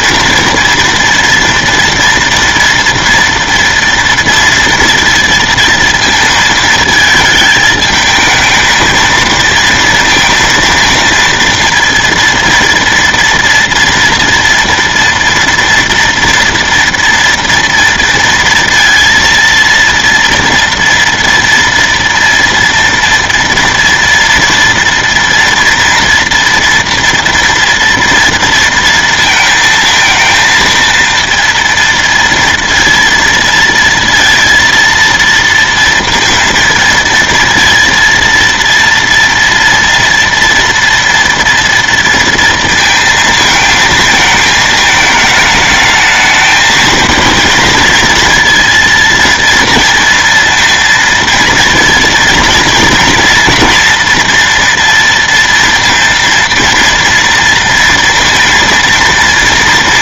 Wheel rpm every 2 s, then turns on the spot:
230, 230, 230, 220, 220, 230, 230, 240, 230, 230, 230, 240, 230, 230, 230, 230, 230, 230, 230, 230, 240, 230, 220, 220, 230, 230, 230, 230, 230, 230.
none